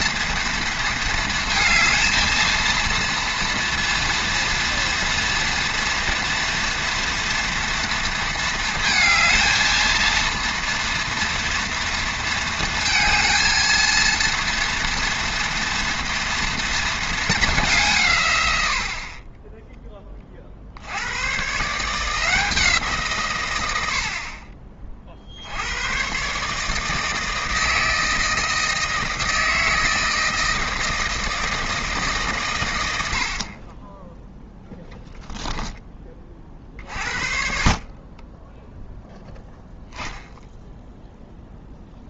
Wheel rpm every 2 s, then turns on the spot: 230, 230, 230, 230, 230, 230, 230, 230, 230, 60, 70, 160, 40, 160, 160, 160, 90, 10, 50, 0, 0.
none